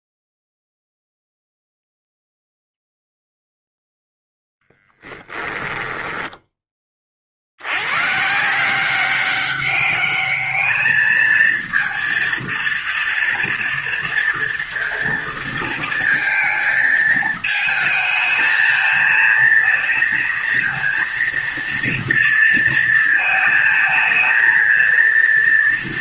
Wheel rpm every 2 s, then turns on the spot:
0, 0, 0, 10, 160, 210, 230, 230, 230, 220, 230, 230, 220.
none